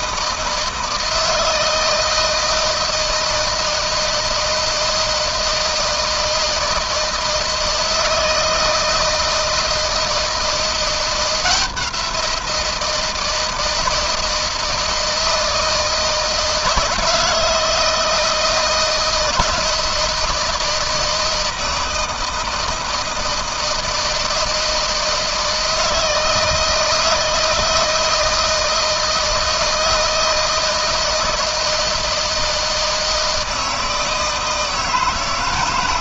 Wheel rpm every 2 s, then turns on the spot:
160, 160, 160, 160, 160, 170, 170, 160, 160, 160, 160, 160, 160, 160, 160, 160, 160, 160.
none